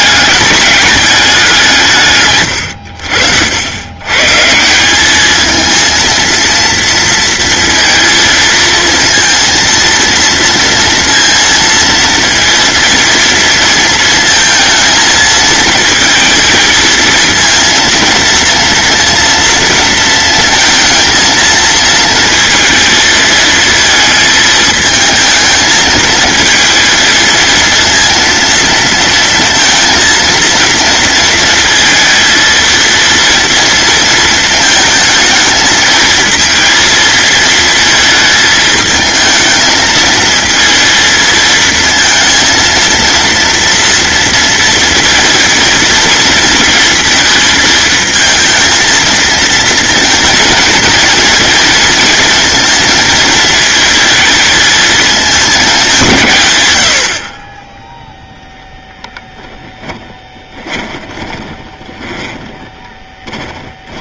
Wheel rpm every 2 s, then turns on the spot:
210, 80, 200, 230, 230, 230, 230, 220, 220, 230, 230, 230, 220, 230, 230, 230, 230, 220, 230, 220, 220, 230, 230, 230, 220, 220, 220, 210, 70, 10, 20, 30.
60-64